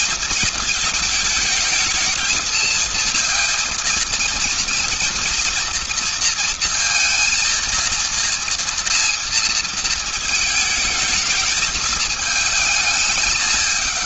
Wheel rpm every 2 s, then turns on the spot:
220, 230, 230, 230, 230, 220, 200.
none